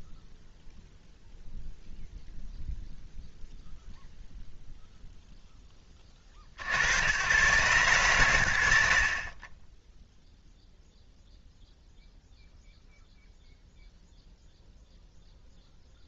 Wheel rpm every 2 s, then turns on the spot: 0, 0, 0, 90, 80, 0, 0, 0.
none